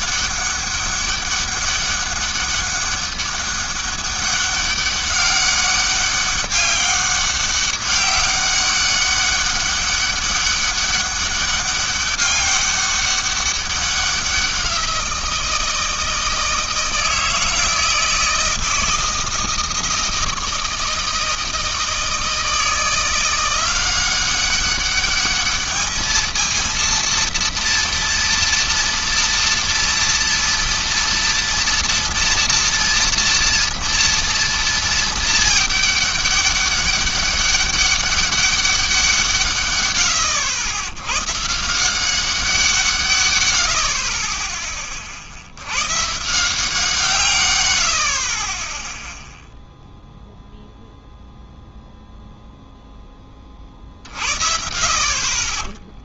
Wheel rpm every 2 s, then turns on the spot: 200, 200, 200, 200, 200, 200, 200, 180, 160, 160, 160, 160, 200, 230, 230, 230, 240, 230, 200, 190, 90, 170, 20, 170, 20, 0, 0, 50.
48-50